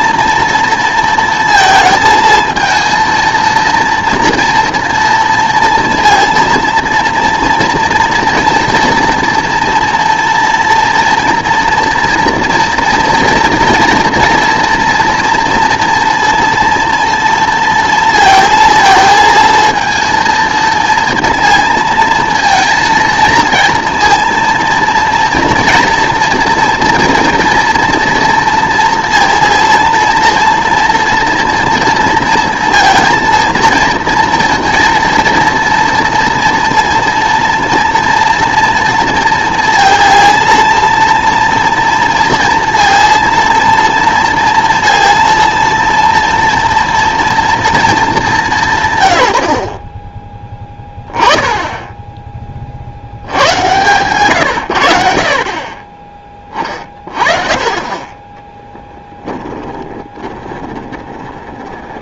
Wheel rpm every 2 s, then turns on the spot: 230, 230, 230, 230, 230, 230, 230, 230, 230, 230, 230, 230, 230, 230, 230, 230, 230, 230, 230, 230, 230, 230, 230, 230, 150, 10, 50, 100, 20, 10, 20.
58-62